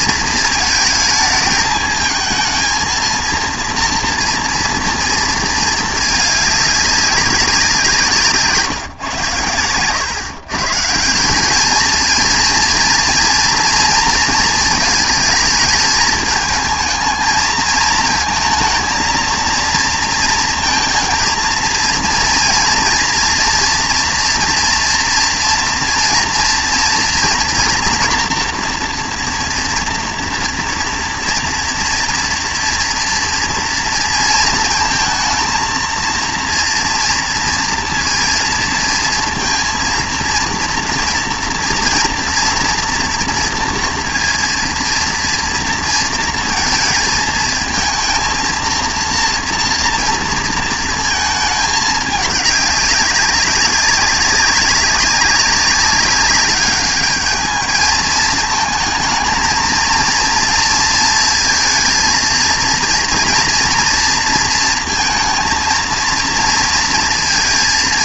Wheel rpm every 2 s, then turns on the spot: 220, 230, 230, 210, 150, 150, 230, 220, 220, 220, 230, 230, 230, 230, 230, 240, 230, 230, 230, 230, 230, 240, 230, 230, 230, 230, 200, 200, 210, 220, 230, 230, 230, 230.
none